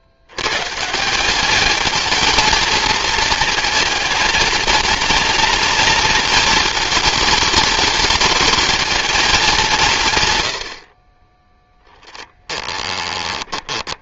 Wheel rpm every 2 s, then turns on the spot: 140, 220, 220, 220, 220, 60, 10.
12-14